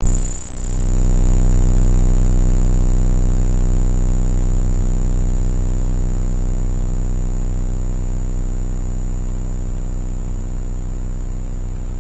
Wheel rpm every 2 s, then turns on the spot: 0, 0, 0, 0, 0, 0.
none